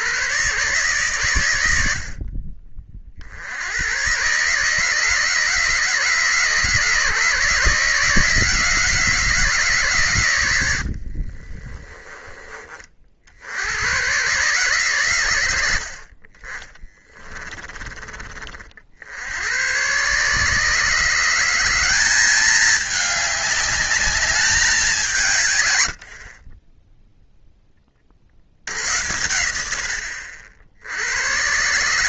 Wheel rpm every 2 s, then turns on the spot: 130, 50, 150, 150, 150, 50, 60, 100, 20, 80, 160, 210, 150, 10, 90, 110.
10-12 16-18